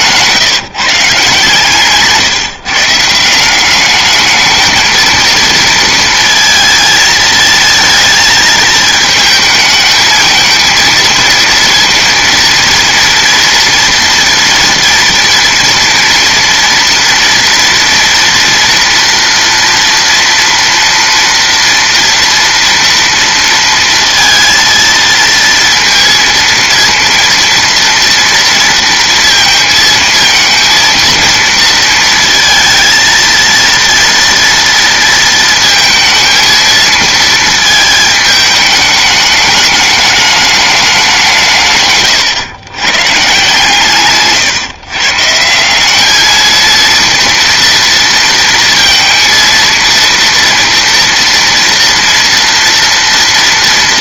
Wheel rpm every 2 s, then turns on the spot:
150, 150, 220, 220, 220, 220, 230, 230, 230, 240, 230, 230, 230, 230, 230, 230, 230, 230, 230, 210, 210, 120, 130, 230, 220, 230, 230.
none